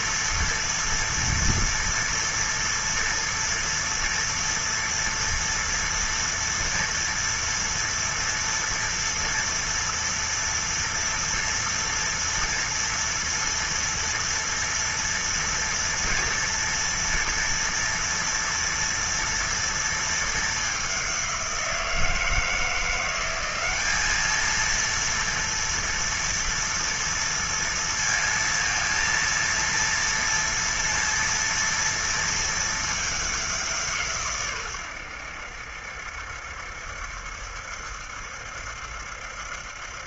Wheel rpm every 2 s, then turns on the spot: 230, 230, 230, 230, 230, 230, 230, 230, 230, 230, 220, 170, 210, 230, 230, 230, 230, 150, 70, 70.
none